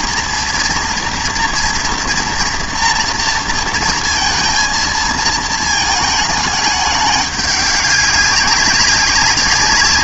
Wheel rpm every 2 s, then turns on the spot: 230, 230, 230, 210, 200.
none